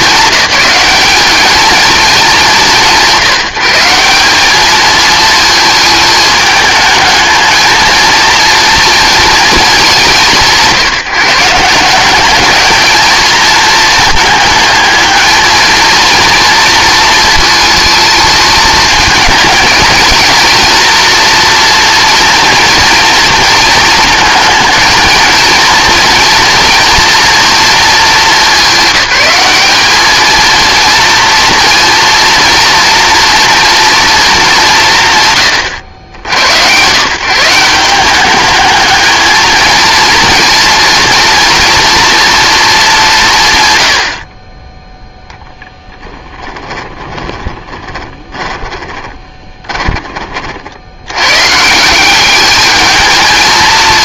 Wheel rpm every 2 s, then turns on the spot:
190, 180, 220, 220, 230, 160, 220, 220, 220, 220, 230, 230, 220, 230, 200, 230, 230, 170, 120, 210, 230, 210, 10, 20, 30, 80, 210.
46-50